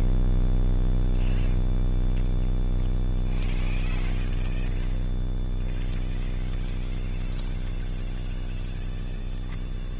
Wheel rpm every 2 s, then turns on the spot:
0, 0, 0, 0, 0.
none